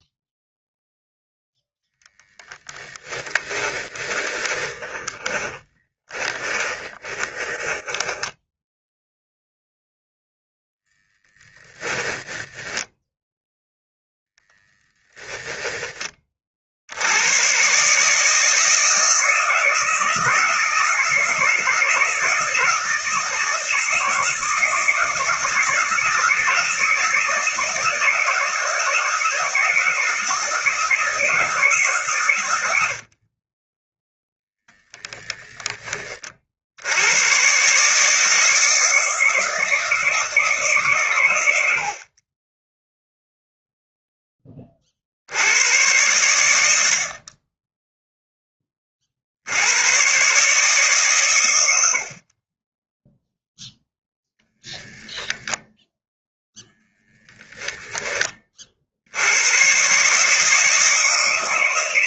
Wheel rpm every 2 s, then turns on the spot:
0, 20, 40, 30, 0, 10, 10, 10, 70, 160, 170, 170, 160, 160, 160, 160, 80, 0, 80, 160, 130, 0, 40, 70, 30, 140, 20, 0, 0, 60, 160.
2-8 12-16 32-34